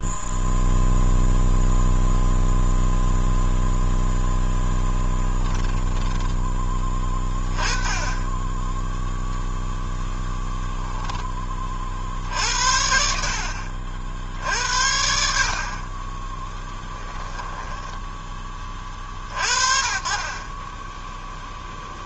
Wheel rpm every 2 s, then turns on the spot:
0, 0, 10, 20, 10, 0, 60, 60, 10, 50, 20.
4-6 16-18